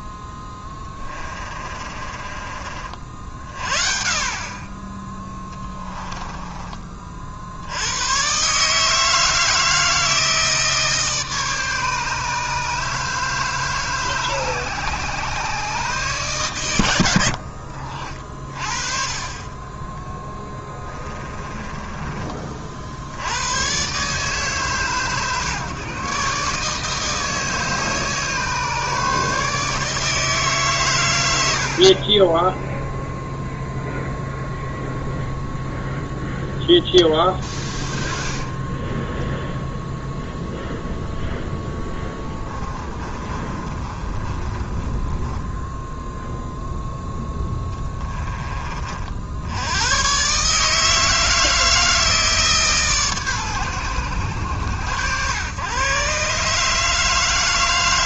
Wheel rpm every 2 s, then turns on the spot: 10, 40, 20, 20, 140, 160, 150, 140, 120, 40, 10, 50, 140, 150, 150, 150, 0, 0, 10, 20, 0, 20, 20, 0, 30, 150, 150, 90, 150.
0-2 20-22 38-40 42-46